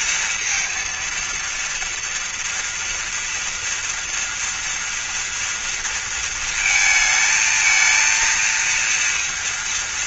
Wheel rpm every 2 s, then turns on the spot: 230, 230, 230, 220, 230.
none